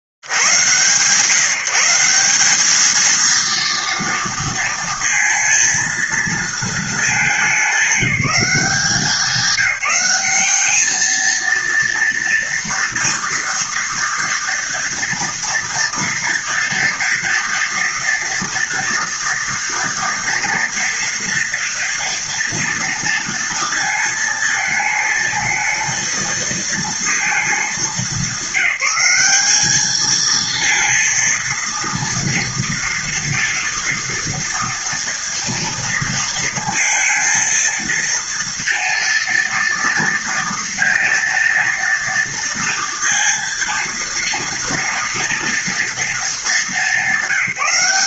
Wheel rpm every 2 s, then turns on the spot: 50, 190, 230, 230, 180, 200, 230, 230, 230, 230, 230, 230, 220, 220, 200, 220, 230, 230, 230, 230, 230, 230, 230, 210.
none